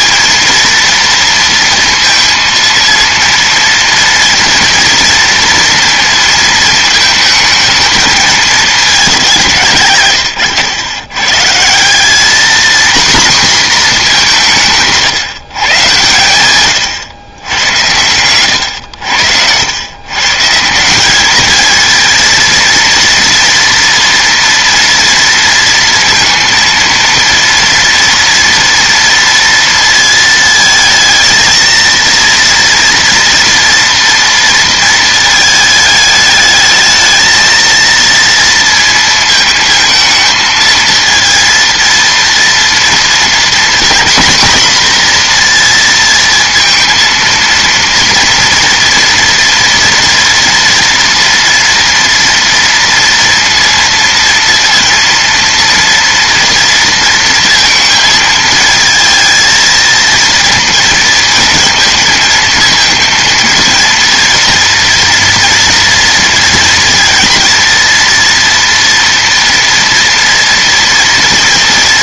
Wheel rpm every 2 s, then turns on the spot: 230, 230, 230, 220, 190, 100, 240, 150, 110, 80, 200, 230, 230, 230, 230, 220, 230, 220, 220, 230, 220, 230, 240, 230, 240, 240, 230, 230, 230, 220, 230, 230, 230, 230, 230, 230.
none